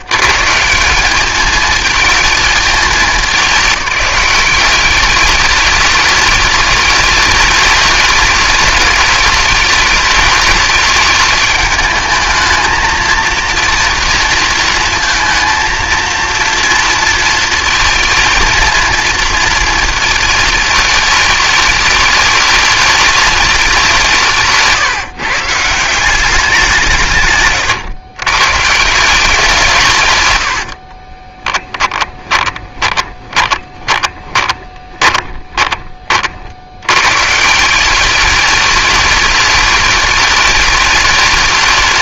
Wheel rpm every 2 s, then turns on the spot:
150, 210, 200, 210, 210, 210, 220, 230, 230, 220, 210, 210, 150, 160, 160, 60, 20, 30, 110, 210, 210.
30-36